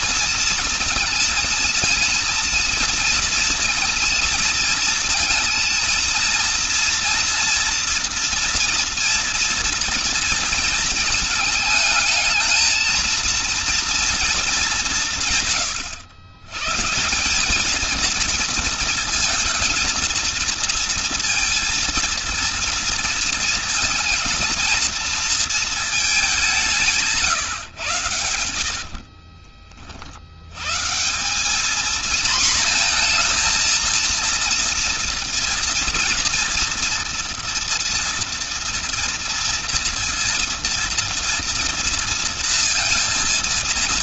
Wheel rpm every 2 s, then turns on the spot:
230, 230, 230, 230, 230, 230, 220, 200, 140, 230, 230, 230, 230, 190, 80, 120, 230, 230, 230, 230, 230, 230.
28-30